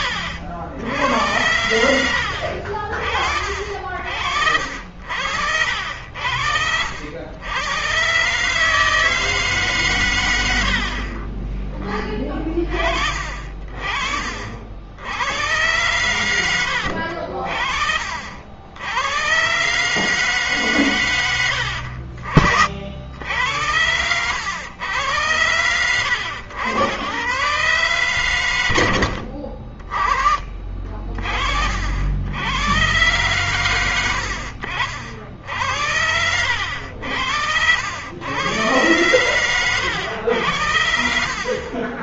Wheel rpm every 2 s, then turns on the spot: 80, 60, 70, 80, 140, 90, 40, 60, 100, 60, 140, 50, 90, 100, 110, 40, 90, 70, 80, 100, 80.
none